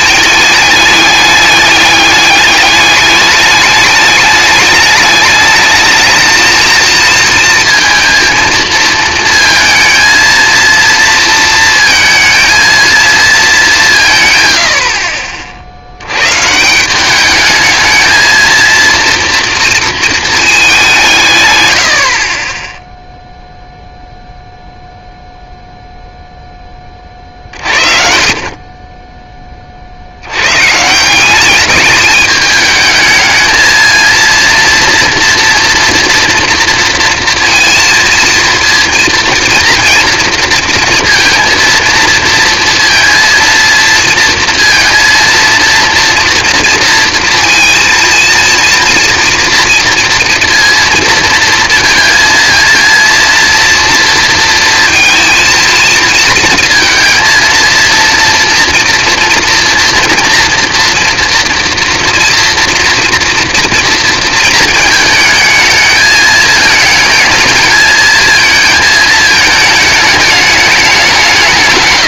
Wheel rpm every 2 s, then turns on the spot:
210, 210, 220, 230, 230, 230, 160, 90, 220, 230, 60, 0, 0, 50, 30, 200, 220, 230, 230, 230, 230, 230, 230, 230, 230, 230, 230, 230, 230, 240, 240, 230, 220, 220, 210, 150.
none